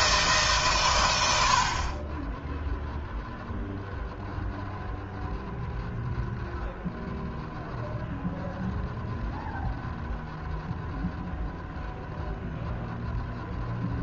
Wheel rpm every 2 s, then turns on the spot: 120, 0, 0, 0, 0, 0, 0.
none